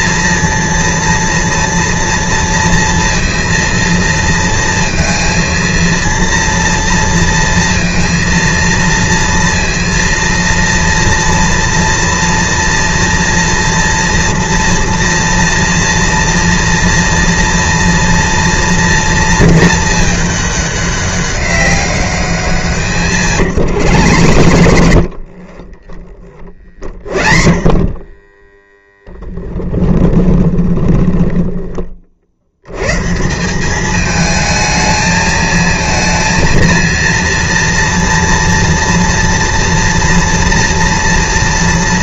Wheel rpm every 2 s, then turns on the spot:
230, 230, 230, 230, 230, 230, 230, 230, 230, 230, 200, 170, 80, 40, 10, 20, 100, 220, 230, 230, 230.
24-32